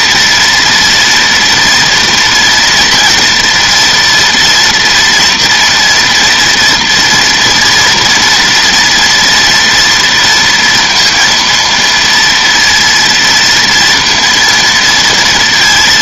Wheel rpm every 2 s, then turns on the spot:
230, 240, 230, 230, 230, 230, 230, 230.
none